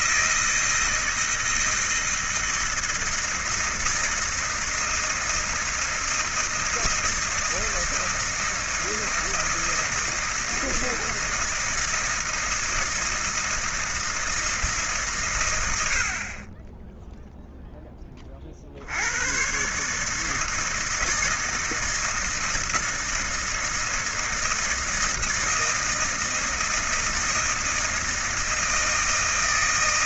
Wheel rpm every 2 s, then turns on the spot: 160, 160, 160, 160, 160, 160, 160, 150, 10, 60, 160, 160, 160, 160, 160.
none